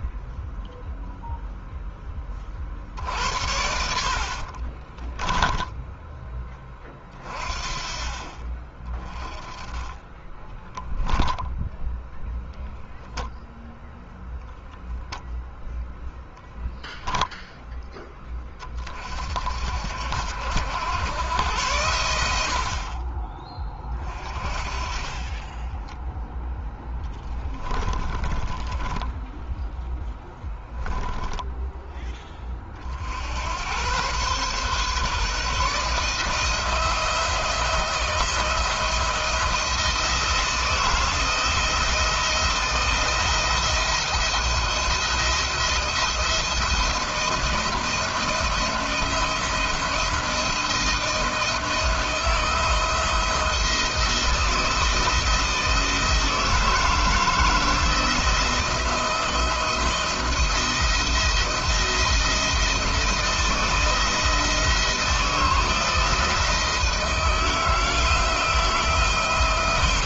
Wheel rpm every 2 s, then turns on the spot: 0, 50, 40, 20, 30, 10, 0, 0, 0, 40, 90, 70, 40, 10, 20, 10, 30, 130, 160, 170, 170, 160, 170, 170, 170, 170, 170, 170, 160, 170, 170, 170, 160, 160, 160.
4-6 10-12 26-32